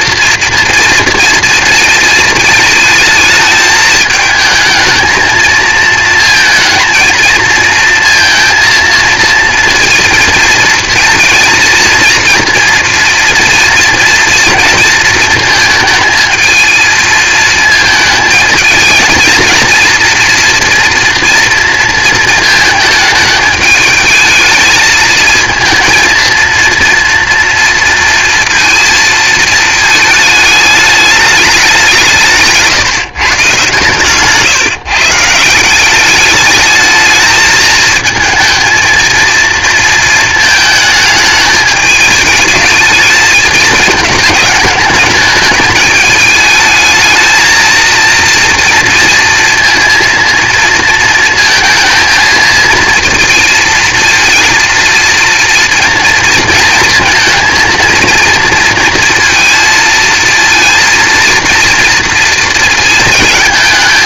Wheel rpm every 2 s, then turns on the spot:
230, 220, 220, 230, 230, 230, 230, 230, 220, 220, 240, 220, 220, 230, 230, 210, 150, 150, 220, 230, 220, 220, 210, 220, 230, 230, 230, 230, 230, 230, 230, 220.
32-34